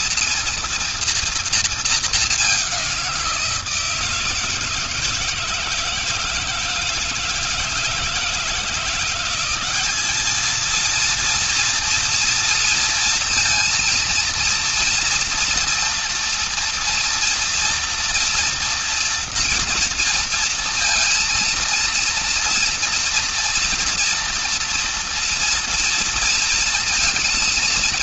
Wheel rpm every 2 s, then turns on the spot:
230, 190, 160, 160, 170, 230, 230, 230, 230, 230, 230, 230, 230, 230.
none